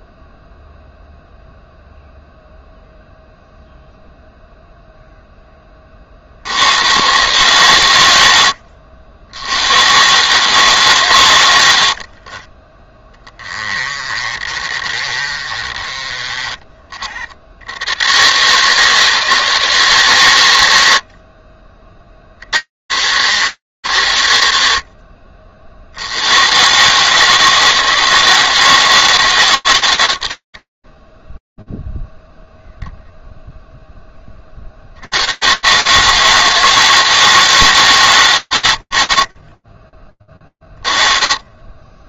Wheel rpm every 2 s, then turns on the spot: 0, 0, 0, 80, 80, 140, 30, 30, 30, 140, 100, 50, 80, 80, 160, 80, 0, 40, 160, 130, 20.
12-16